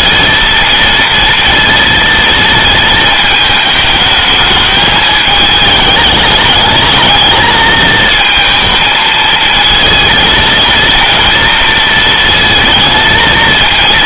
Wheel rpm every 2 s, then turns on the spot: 230, 220, 210, 210, 220, 230, 220.
none